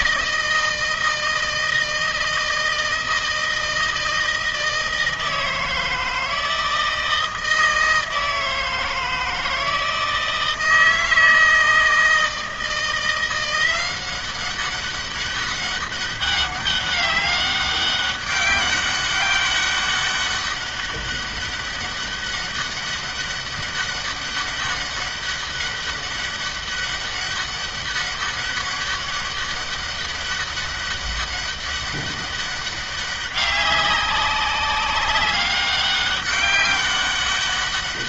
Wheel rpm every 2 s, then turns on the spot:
160, 160, 160, 160, 160, 160, 160, 190, 200, 200, 200, 200, 200, 200, 200, 200, 200, 200, 200.
none